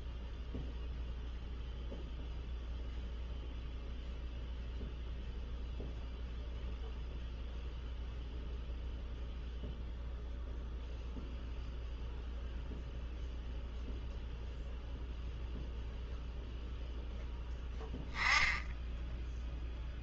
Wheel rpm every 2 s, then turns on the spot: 0, 0, 0, 0, 0, 0, 0, 0, 0, 10.
none